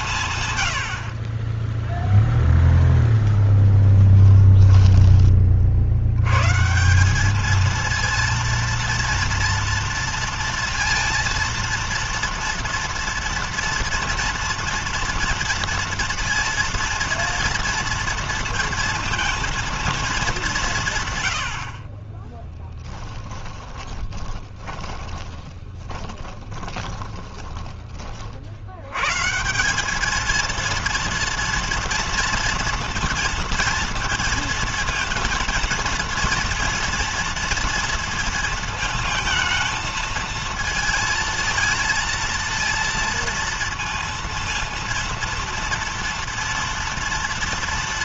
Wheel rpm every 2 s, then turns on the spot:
70, 0, 10, 170, 230, 230, 230, 230, 230, 230, 140, 10, 20, 20, 100, 230, 230, 220, 230, 220, 220, 230, 230, 230.
22-28